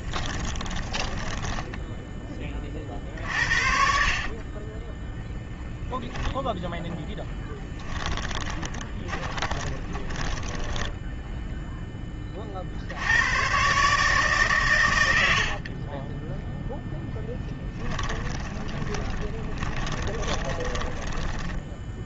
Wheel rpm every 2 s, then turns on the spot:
30, 10, 10, 20, 10, 70, 150, 0, 20, 20, 40.
6-10 16-20